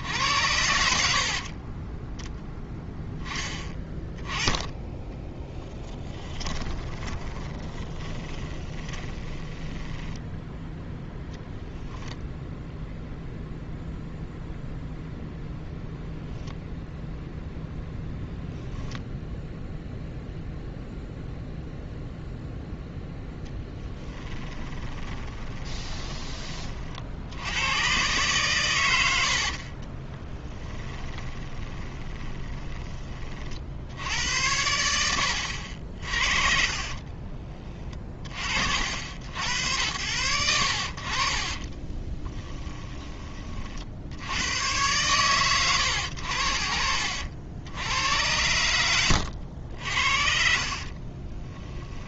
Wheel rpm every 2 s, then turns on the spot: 70, 10, 10, 20, 20, 0, 0, 0, 10, 0, 0, 0, 20, 40, 110, 10, 20, 80, 50, 60, 60, 20, 110, 60, 90, 40.
6-10 16-18 24-26 30-34 36-38 42-44 48-52